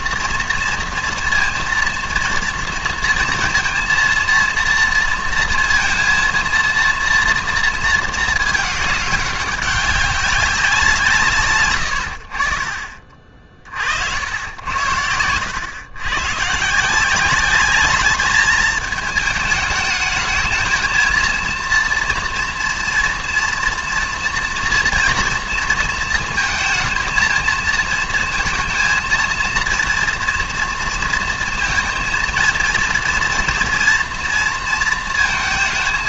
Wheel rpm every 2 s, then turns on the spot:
230, 230, 230, 230, 210, 180, 50, 80, 140, 210, 220, 230, 230, 230, 220, 230, 230, 230.
none